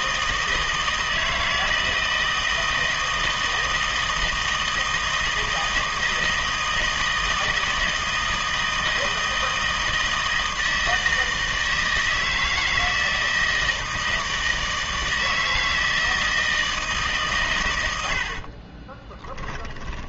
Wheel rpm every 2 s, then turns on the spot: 160, 160, 160, 160, 160, 160, 160, 160, 160, 40.
18-20